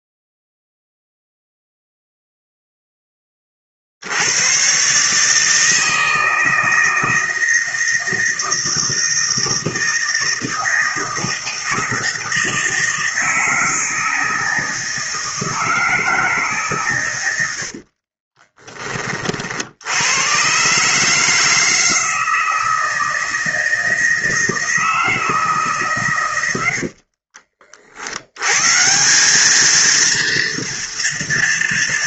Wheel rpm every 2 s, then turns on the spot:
0, 0, 120, 160, 160, 160, 160, 160, 140, 20, 140, 160, 160, 80, 150, 230.
26-28